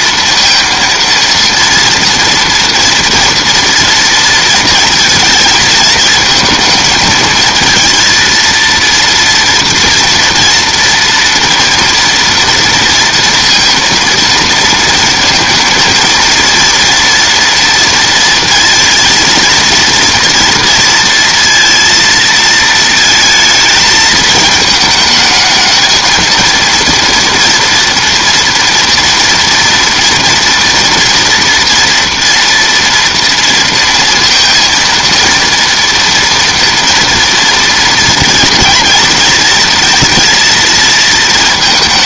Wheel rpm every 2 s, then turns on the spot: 230, 230, 230, 220, 230, 230, 230, 230, 230, 230, 230, 230, 220, 230, 230, 230, 230, 230, 230, 230, 230.
none